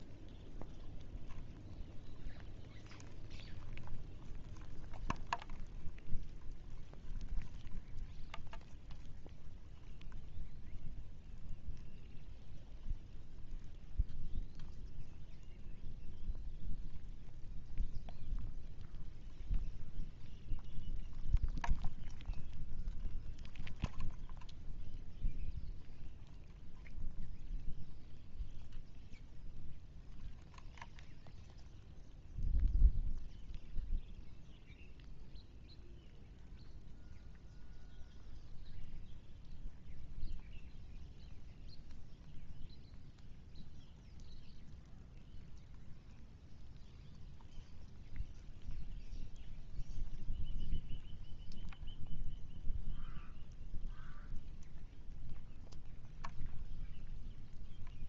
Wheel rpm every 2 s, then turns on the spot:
0, 0, 0, 0, 0, 0, 0, 0, 0, 0, 0, 0, 0, 0, 0, 0, 0, 0, 0, 0, 0, 0, 0, 0, 0, 0, 0, 0, 0.
none